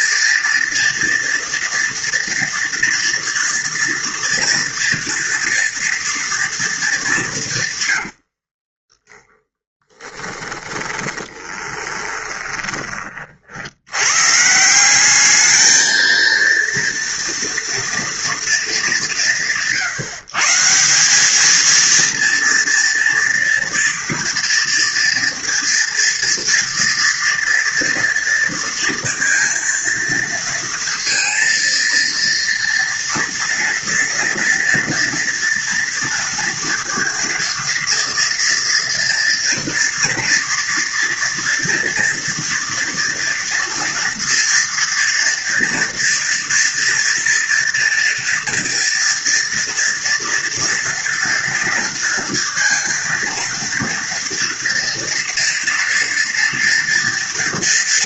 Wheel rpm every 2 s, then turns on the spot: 240, 230, 230, 210, 30, 10, 30, 180, 230, 170, 180, 230, 230, 230, 230, 230, 230, 230, 230, 230, 230, 230, 230, 230, 230, 230, 230, 230, 240.
8-12